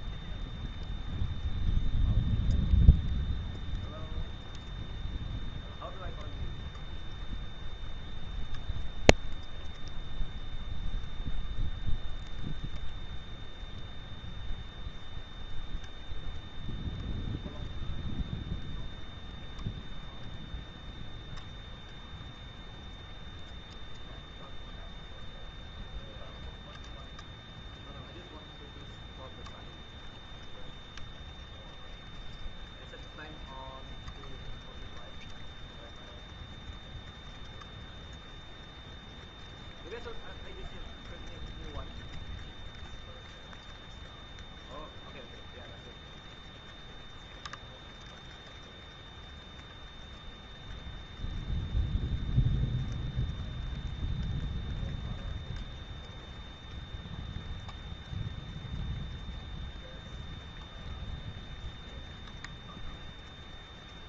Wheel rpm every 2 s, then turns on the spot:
0, 0, 0, 0, 0, 0, 0, 0, 0, 0, 0, 0, 0, 0, 0, 0, 0, 0, 0, 0, 0, 0, 0, 0, 0, 0, 0, 0, 0, 0, 0, 0.
none